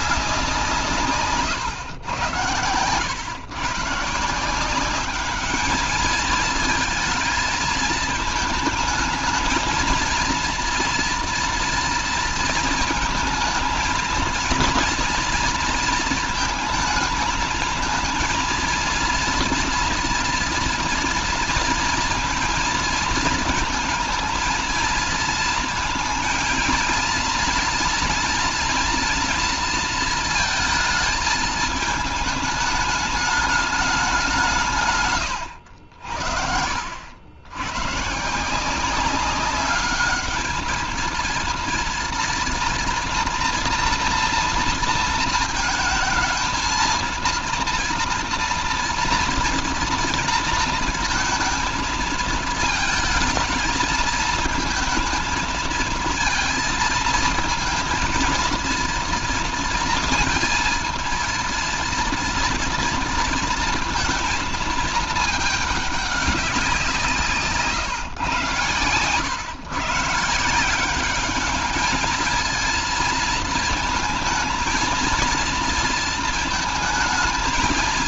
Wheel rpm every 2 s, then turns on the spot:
180, 110, 170, 220, 220, 230, 230, 230, 220, 230, 230, 230, 230, 230, 230, 220, 210, 170, 70, 170, 220, 230, 230, 230, 230, 230, 220, 220, 230, 230, 230, 230, 230, 180, 120, 180, 230, 230, 220.
none